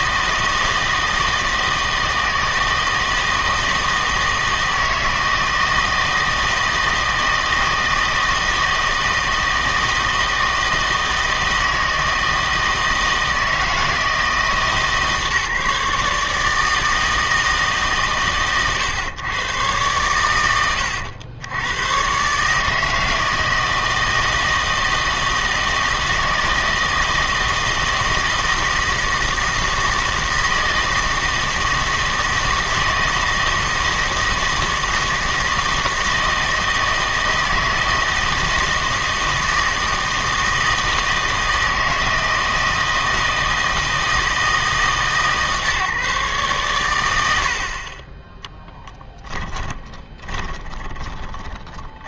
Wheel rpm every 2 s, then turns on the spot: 160, 160, 160, 160, 160, 160, 160, 160, 160, 120, 100, 150, 160, 160, 160, 160, 160, 160, 160, 160, 160, 160, 160, 130, 0, 10.
50-52